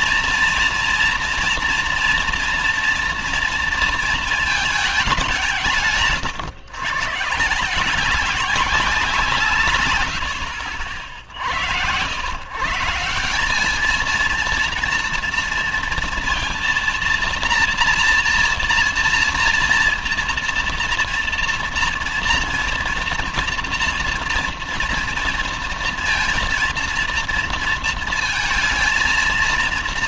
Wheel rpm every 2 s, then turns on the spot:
230, 230, 220, 130, 190, 60, 130, 230, 230, 230, 240, 240, 230, 230, 230.
none